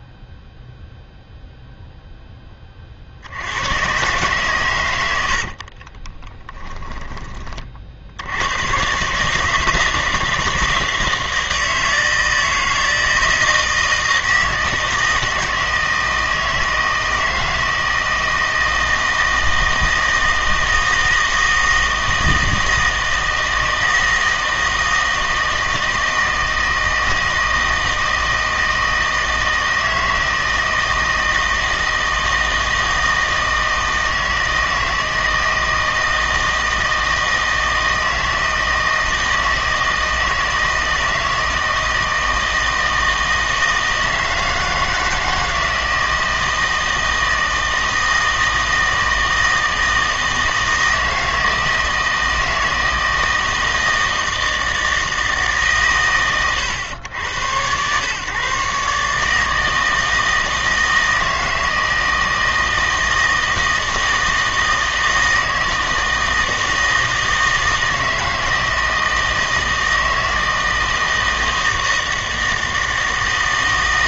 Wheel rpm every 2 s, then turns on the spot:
0, 20, 110, 10, 110, 160, 160, 160, 160, 160, 160, 160, 160, 160, 160, 160, 160, 160, 160, 160, 160, 160, 160, 160, 160, 160, 160, 160, 110, 140, 160, 160, 160, 160, 160, 160, 160.
6-8